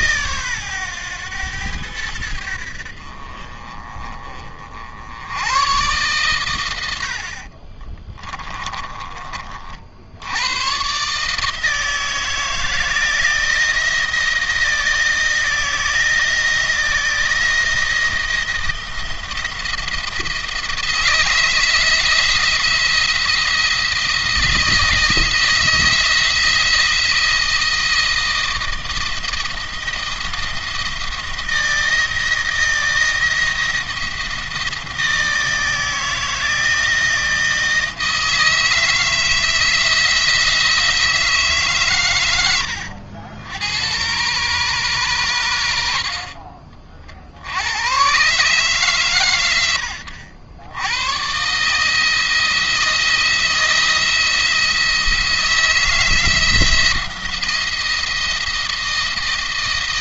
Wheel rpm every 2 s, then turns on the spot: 120, 70, 60, 90, 30, 120, 160, 160, 160, 170, 170, 170, 160, 170, 160, 170, 160, 160, 160, 160, 170, 90, 120, 40, 140, 100, 170, 170, 170, 170.
8-10